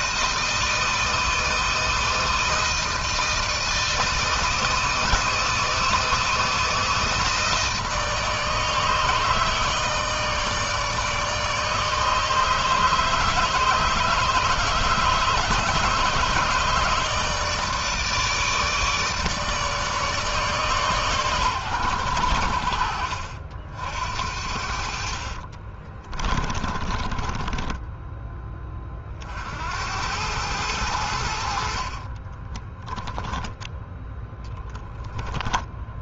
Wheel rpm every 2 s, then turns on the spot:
160, 160, 160, 160, 150, 160, 150, 150, 160, 150, 140, 70, 60, 30, 30, 90, 30, 10.
24-28 32-34